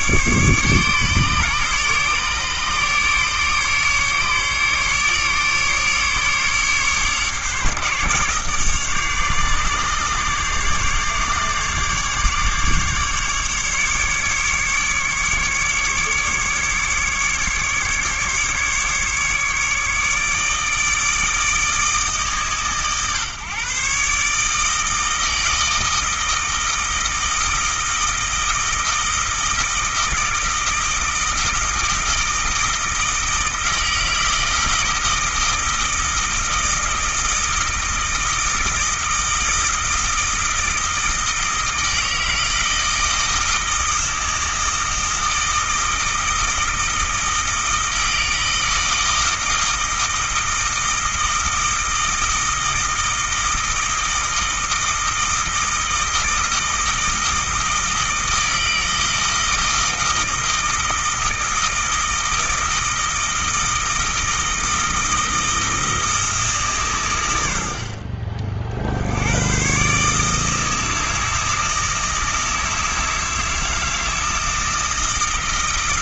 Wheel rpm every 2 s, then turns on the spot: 140, 150, 150, 140, 140, 140, 150, 150, 150, 150, 150, 130, 160, 160, 160, 160, 160, 160, 160, 160, 160, 160, 160, 160, 160, 160, 160, 160, 160, 160, 160, 160, 160, 140, 60, 160, 160, 160.
none